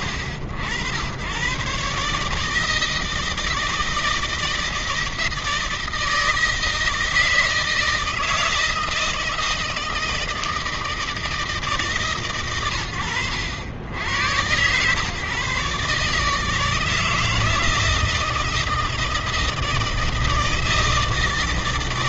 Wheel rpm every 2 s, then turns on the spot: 80, 150, 160, 160, 160, 160, 110, 110, 150, 160, 160.
none